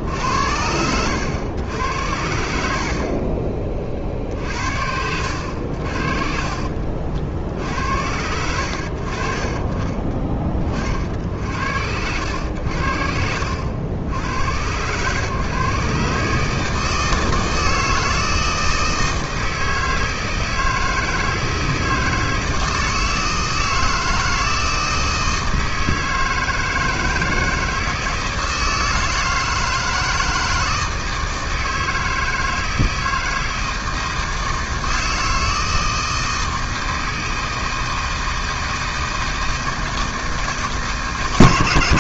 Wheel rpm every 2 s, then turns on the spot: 90, 60, 70, 60, 60, 40, 70, 110, 160, 160, 160, 160, 160, 160, 160, 160, 160, 160, 160, 160, 140.
none